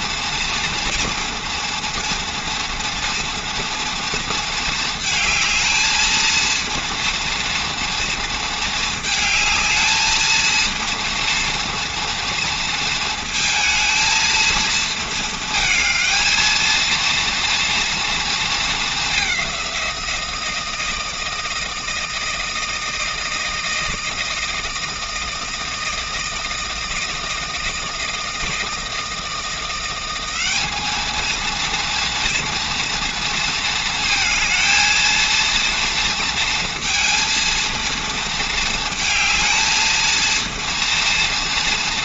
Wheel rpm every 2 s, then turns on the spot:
230, 240, 220, 230, 220, 230, 230, 220, 230, 220, 160, 160, 160, 160, 160, 200, 230, 230, 230, 230, 230.
none